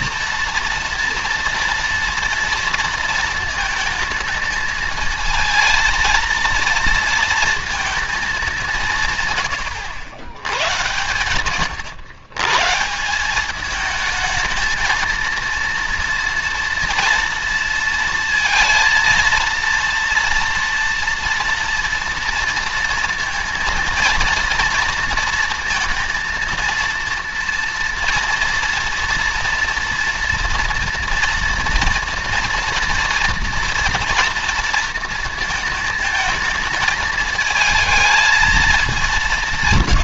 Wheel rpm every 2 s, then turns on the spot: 230, 230, 220, 230, 170, 110, 160, 220, 230, 230, 230, 230, 230, 230, 230, 230, 240, 230, 220, 200.
none